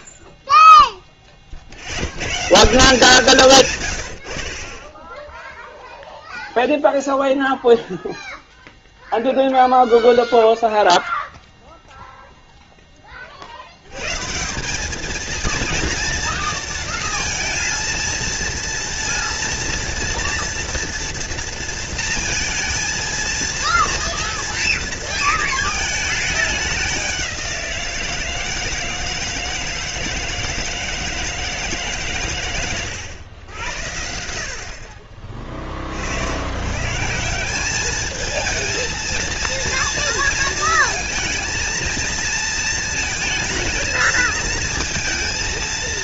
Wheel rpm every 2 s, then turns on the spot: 10, 170, 20, 0, 0, 0, 10, 200, 230, 230, 240, 230, 230, 190, 160, 160, 110, 50, 150, 230, 230, 220, 230.
none